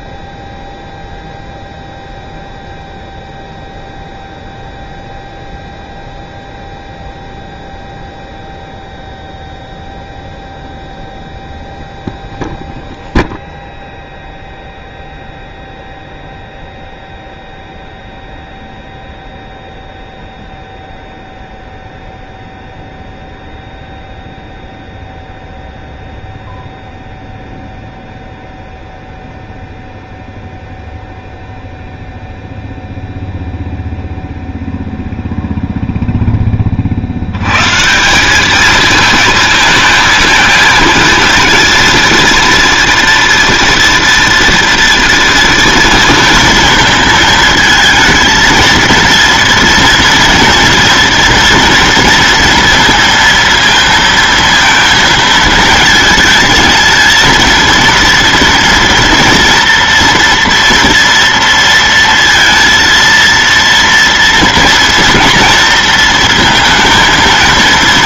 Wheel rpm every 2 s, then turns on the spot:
0, 0, 0, 0, 0, 0, 0, 0, 0, 0, 0, 0, 0, 0, 0, 0, 0, 0, 20, 210, 230, 230, 230, 230, 230, 240, 230, 230, 220, 230, 240, 230, 230, 230.
none